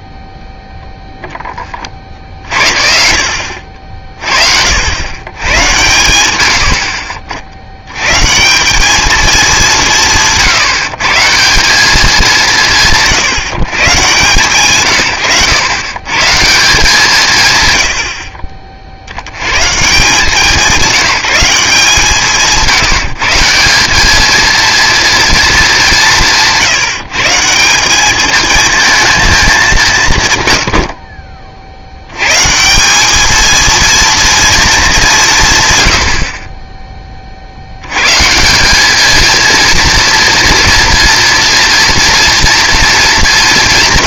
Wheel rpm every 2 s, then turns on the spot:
0, 50, 50, 80, 170, 160, 180, 140, 160, 50, 180, 170, 230, 160, 220, 120, 150, 220, 30, 180, 230, 230.
none